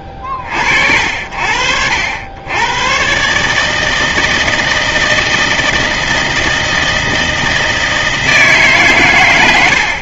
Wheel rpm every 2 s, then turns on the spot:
50, 100, 160, 160, 160.
none